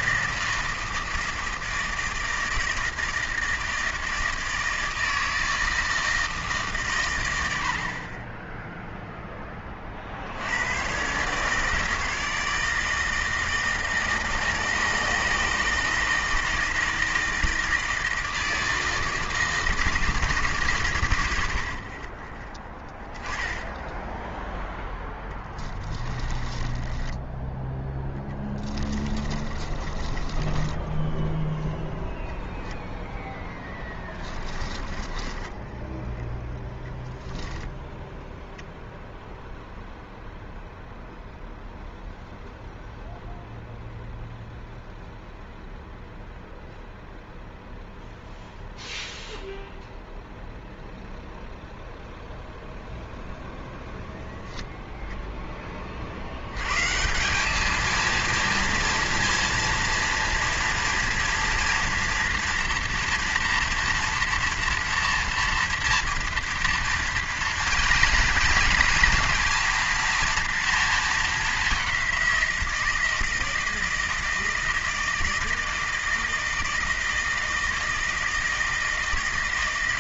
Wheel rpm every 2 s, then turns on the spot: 160, 160, 160, 140, 0, 110, 160, 160, 170, 160, 140, 10, 10, 20, 20, 20, 0, 20, 0, 0, 0, 0, 0, 0, 0, 0, 0, 0, 120, 230, 240, 230, 230, 230, 230, 230, 170, 160, 160, 160.
26-32 34-36